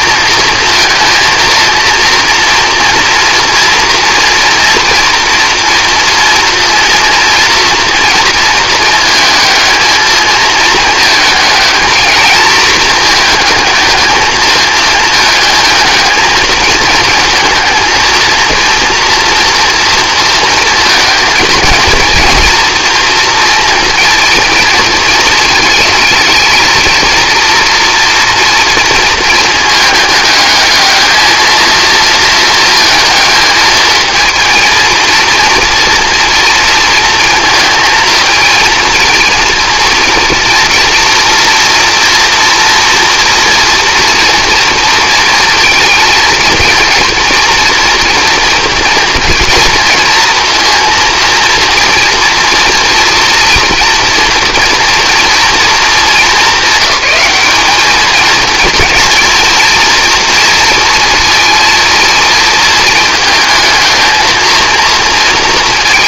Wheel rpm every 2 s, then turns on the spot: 230, 240, 230, 230, 230, 220, 220, 220, 220, 230, 220, 230, 230, 220, 230, 220, 220, 230, 230, 230, 230, 230, 230, 230, 230, 230, 230, 230, 200, 230, 230, 220, 230.
none